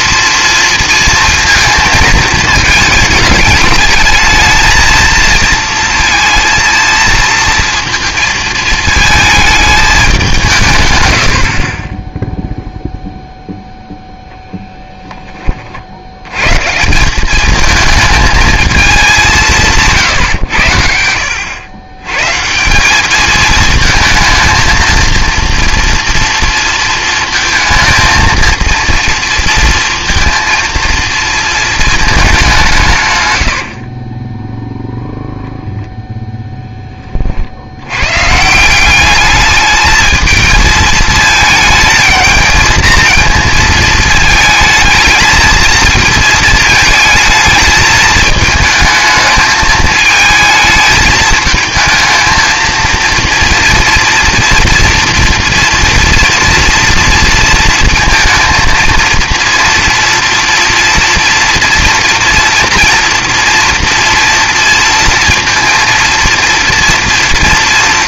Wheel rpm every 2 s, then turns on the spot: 230, 220, 220, 230, 220, 130, 0, 0, 150, 220, 80, 180, 230, 230, 230, 230, 180, 0, 10, 170, 220, 220, 220, 220, 220, 220, 230, 230, 230, 230, 230, 230, 230, 230.
none